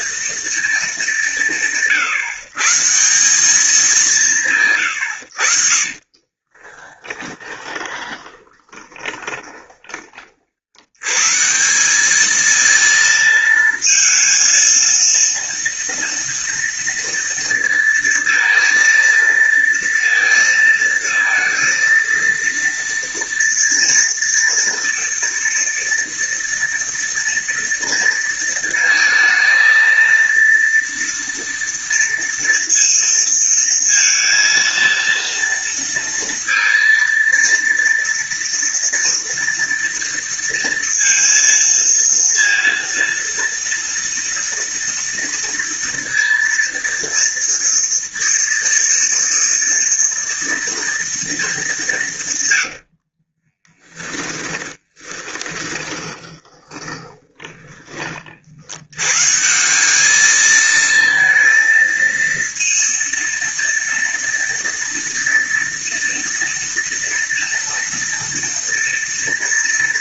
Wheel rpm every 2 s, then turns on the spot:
220, 160, 120, 20, 20, 80, 220, 230, 230, 230, 230, 230, 230, 230, 230, 230, 230, 230, 230, 230, 230, 230, 230, 230, 230, 230, 80, 20, 10, 90, 230, 230, 230, 230, 230.
6-10 52-58